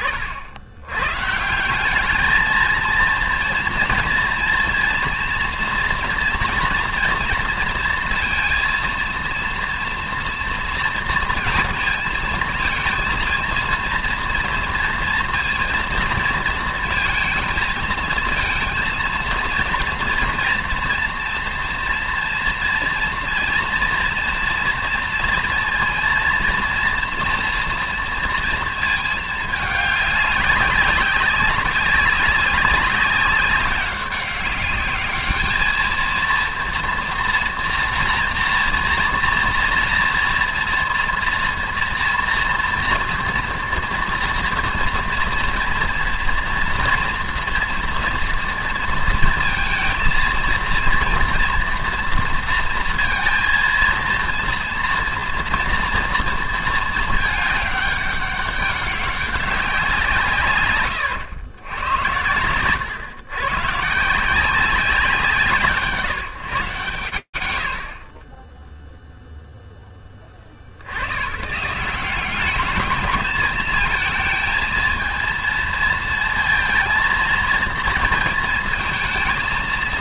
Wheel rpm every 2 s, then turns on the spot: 120, 230, 230, 240, 230, 230, 230, 230, 220, 230, 230, 230, 230, 230, 220, 200, 200, 210, 230, 240, 230, 230, 230, 240, 230, 230, 230, 230, 220, 200, 110, 130, 170, 90, 0, 120, 220, 220, 230, 220.
60-62